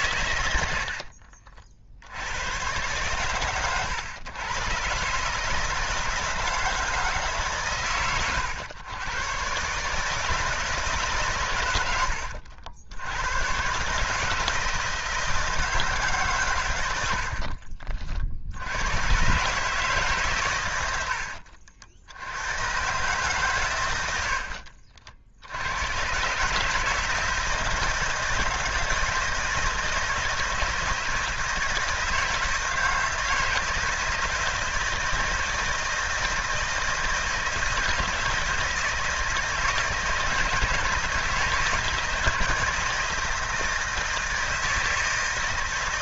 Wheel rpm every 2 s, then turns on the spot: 80, 110, 120, 160, 120, 150, 70, 160, 110, 90, 110, 110, 60, 150, 160, 160, 160, 160, 160, 160, 160, 160, 160.
0-2 24-26